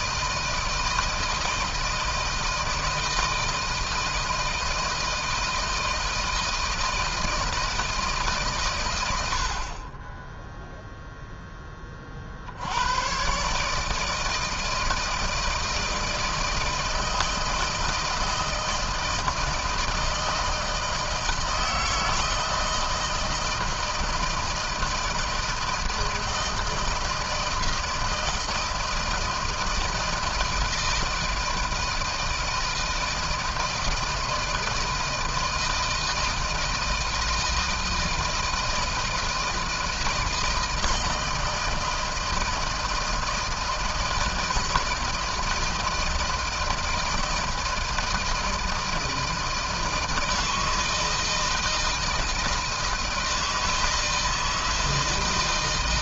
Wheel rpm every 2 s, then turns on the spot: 160, 160, 160, 160, 140, 10, 60, 160, 160, 160, 160, 160, 160, 160, 160, 160, 160, 160, 160, 160, 160, 160, 160, 160, 160, 160, 160, 160.
none